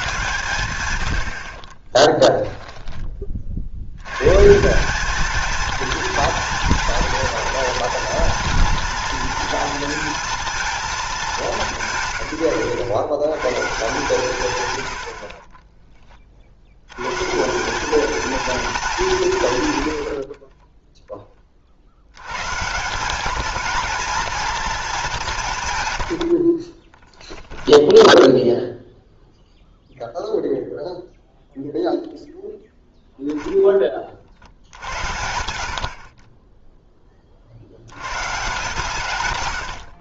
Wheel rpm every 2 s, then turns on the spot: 110, 10, 170, 230, 230, 230, 120, 90, 90, 210, 20, 160, 220, 30, 0, 0, 0, 80, 10, 150.
20-22 26-28